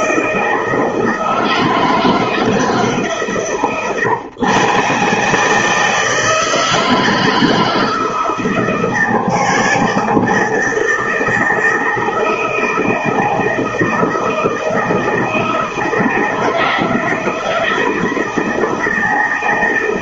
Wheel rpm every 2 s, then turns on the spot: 160, 150, 140, 160, 160, 160, 160, 160, 160, 160.
none